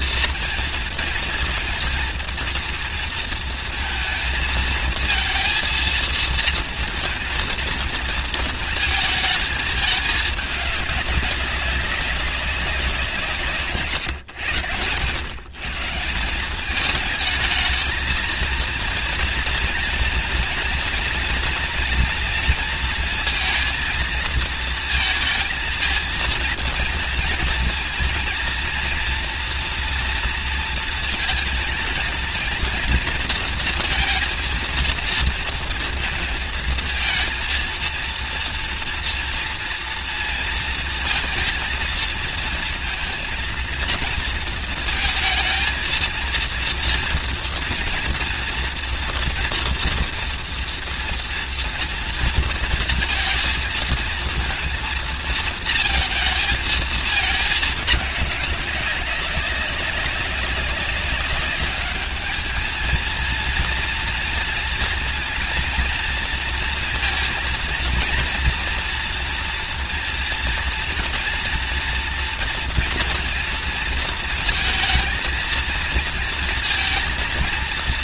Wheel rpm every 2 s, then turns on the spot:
230, 230, 220, 230, 220, 210, 190, 100, 200, 230, 230, 230, 220, 230, 230, 230, 230, 230, 220, 230, 230, 230, 230, 230, 230, 230, 230, 230, 220, 200, 190, 220, 230, 230, 240, 230, 240, 220, 230.
none